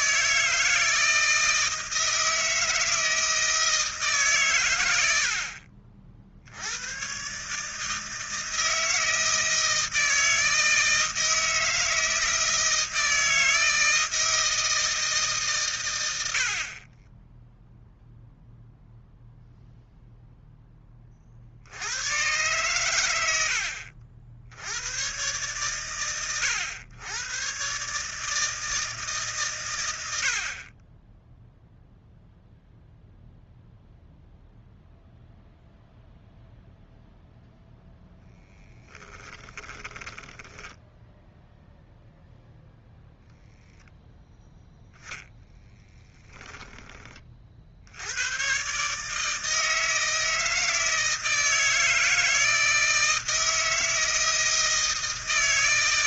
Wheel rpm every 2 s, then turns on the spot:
160, 160, 100, 100, 160, 160, 160, 160, 40, 0, 10, 110, 100, 100, 160, 30, 0, 0, 0, 10, 10, 0, 0, 20, 140, 160, 160, 160.
16-18 38-40